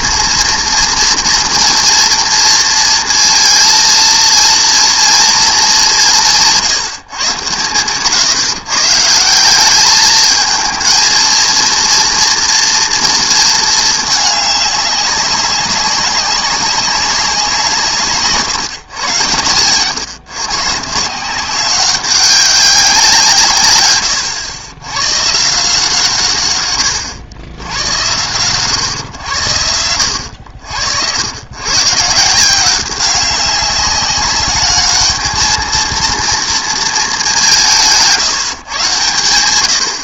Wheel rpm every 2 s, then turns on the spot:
230, 230, 230, 170, 140, 220, 230, 200, 190, 140, 150, 190, 100, 120, 130, 80, 180, 210, 220, 140.
none